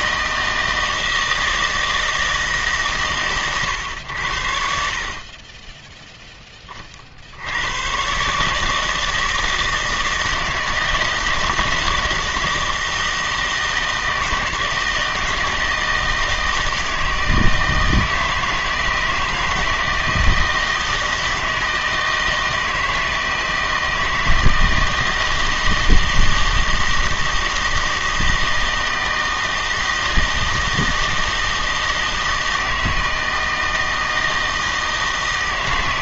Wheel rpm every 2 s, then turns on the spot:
160, 150, 60, 20, 160, 160, 160, 160, 160, 160, 160, 160, 170, 160, 160, 160, 160, 160.
none